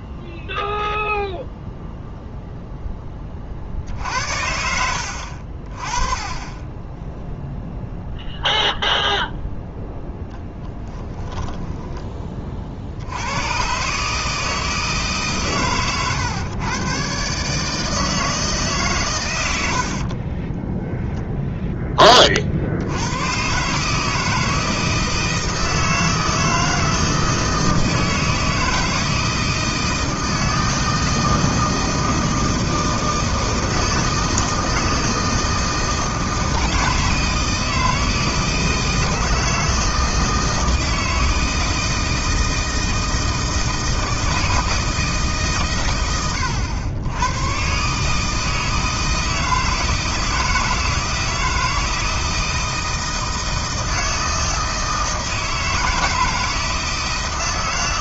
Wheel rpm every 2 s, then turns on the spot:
0, 0, 80, 10, 0, 10, 50, 160, 110, 150, 10, 70, 160, 160, 160, 160, 160, 160, 160, 160, 160, 160, 160, 90, 160, 160, 160, 160, 160.
10-12